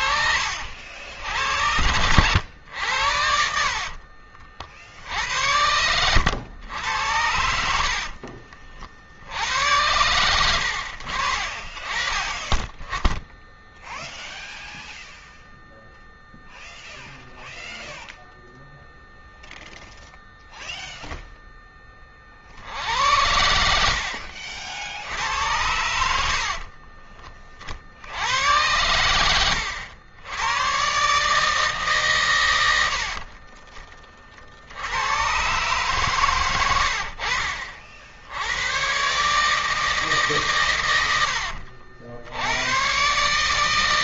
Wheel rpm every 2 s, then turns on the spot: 60, 90, 60, 90, 60, 90, 10, 0, 0, 0, 0, 50, 60, 50, 90, 110, 110, 50, 110, 90, 130, 90.
26-28